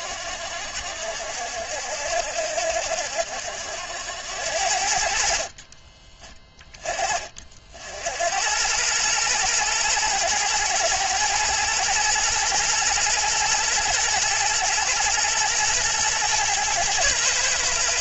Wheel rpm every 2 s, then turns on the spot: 70, 70, 60, 30, 110, 110, 120, 120, 110.
none